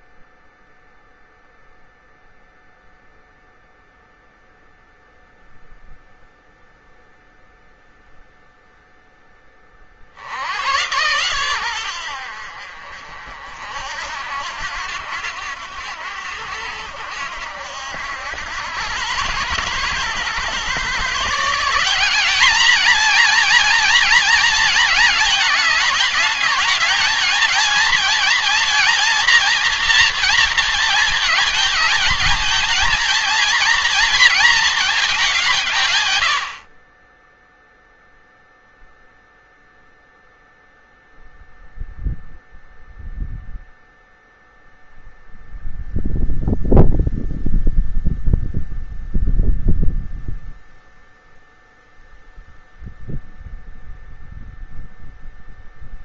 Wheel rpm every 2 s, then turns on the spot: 0, 0, 0, 0, 0, 100, 60, 80, 70, 100, 140, 220, 220, 220, 230, 220, 230, 220, 40, 0, 0, 0, 0, 0, 0, 0, 0, 0.
none